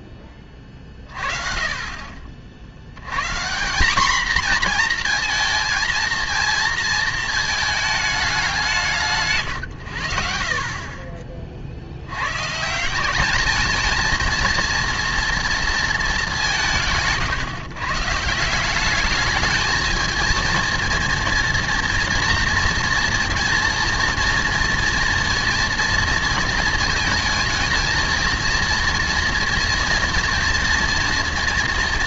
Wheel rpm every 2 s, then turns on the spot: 30, 70, 230, 230, 170, 40, 150, 230, 180, 180, 230, 230, 230, 220, 230, 240.
none